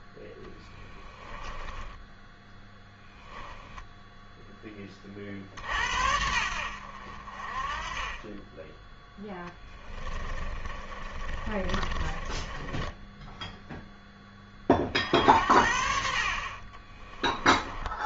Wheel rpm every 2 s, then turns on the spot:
10, 10, 20, 70, 10, 30, 10, 50, 20.
0-2 10-14 16-18